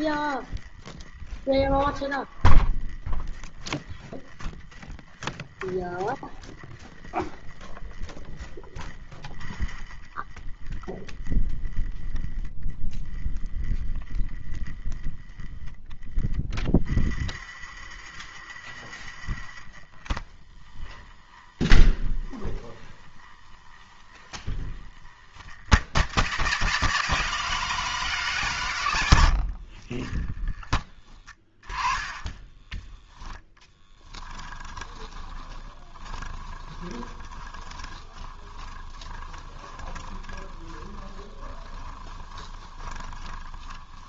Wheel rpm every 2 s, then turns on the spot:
20, 10, 10, 10, 10, 20, 10, 10, 20, 30, 20, 20, 20, 120, 110, 20, 10, 20, 20, 20, 20, 20.
20-24 30-44